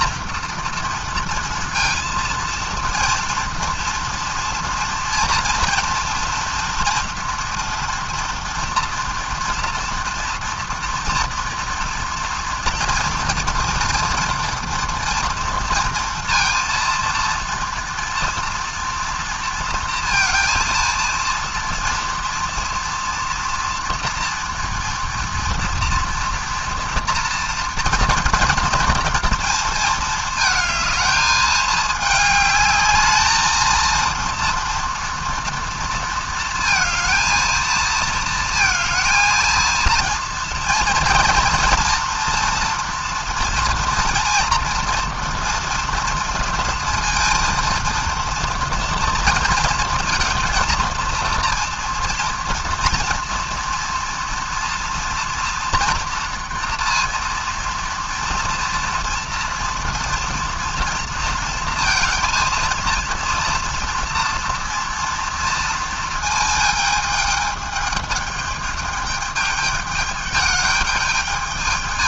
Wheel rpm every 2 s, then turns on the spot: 230, 230, 230, 240, 240, 240, 230, 230, 230, 230, 230, 230, 230, 230, 230, 220, 210, 230, 230, 220, 230, 230, 230, 230, 230, 230, 230, 230, 230, 230, 230, 230, 230, 220, 210, 210.
none